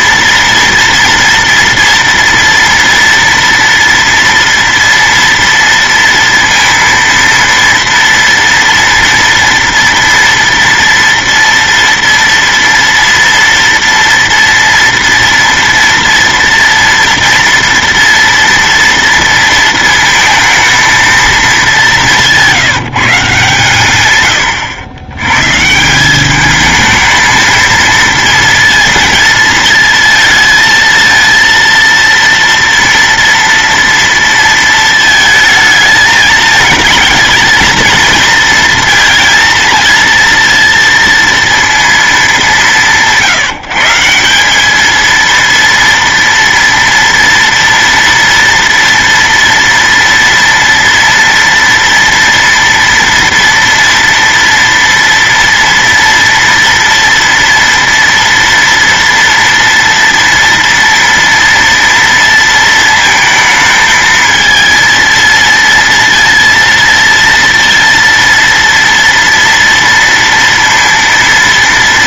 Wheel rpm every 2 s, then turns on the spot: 240, 230, 230, 230, 230, 230, 230, 230, 230, 230, 230, 170, 110, 210, 230, 230, 230, 230, 220, 230, 230, 170, 200, 230, 230, 230, 230, 230, 230, 230, 230, 230, 220, 230, 230, 230.
none